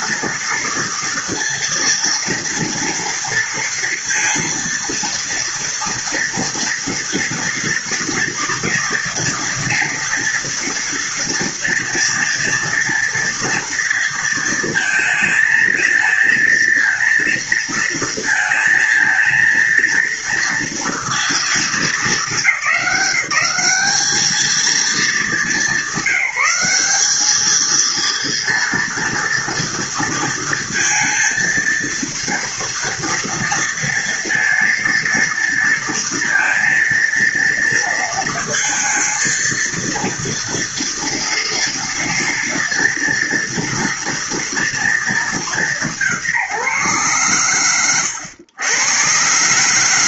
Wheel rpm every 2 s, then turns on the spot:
230, 230, 230, 230, 230, 230, 230, 230, 230, 230, 230, 210, 210, 190, 230, 230, 230, 230, 230, 220, 230, 230, 230, 150, 100.
none